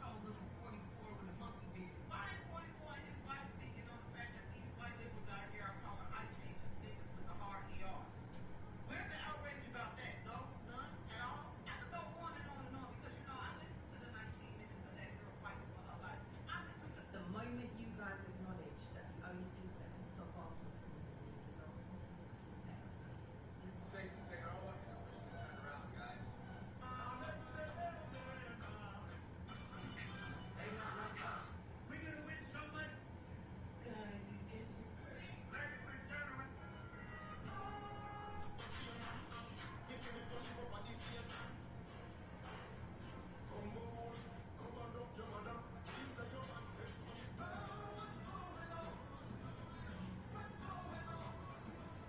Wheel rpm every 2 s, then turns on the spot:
0, 0, 0, 0, 0, 0, 0, 0, 0, 0, 0, 0, 0, 0, 0, 0, 0, 0, 0, 0, 0, 0, 0, 0, 0, 0.
none